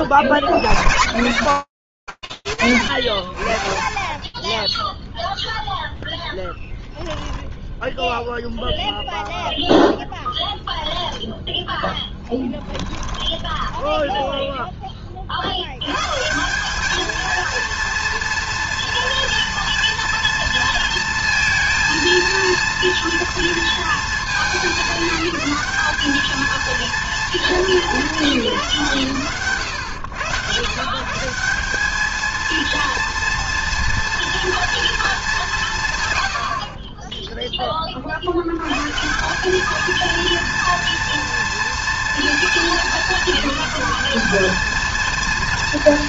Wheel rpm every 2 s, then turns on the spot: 30, 0, 10, 0, 10, 10, 30, 220, 230, 230, 230, 210, 220, 140, 140, 230, 210, 10, 150, 230, 220, 230, 230.
4-6 8-12